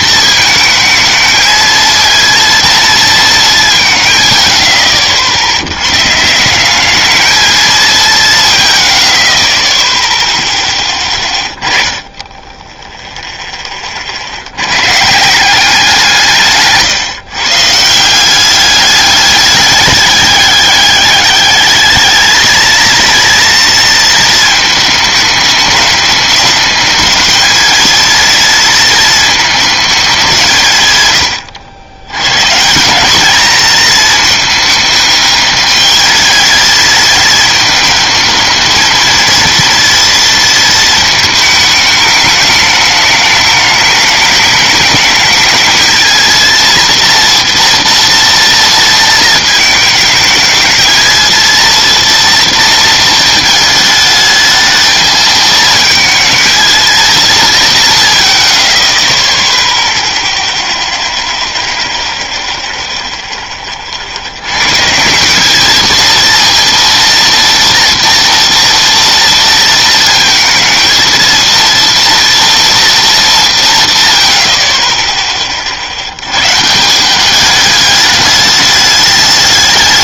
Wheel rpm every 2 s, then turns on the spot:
220, 230, 90, 170, 100, 10, 10, 90, 160, 190, 200, 220, 220, 210, 230, 170, 140, 220, 220, 220, 230, 210, 210, 230, 230, 220, 230, 220, 220, 60, 0, 0, 90, 230, 230, 220, 240, 60, 130, 210.
none